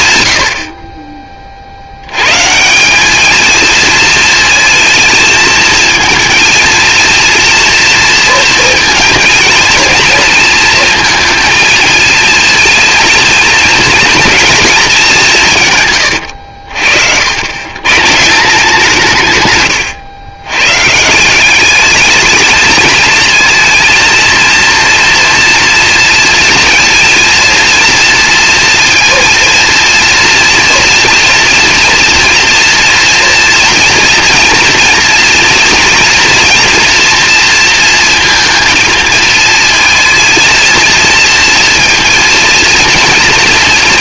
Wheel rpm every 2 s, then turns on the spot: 60, 170, 220, 230, 230, 230, 230, 210, 80, 180, 140, 220, 230, 230, 230, 230, 230, 230, 240, 230, 230, 230.
none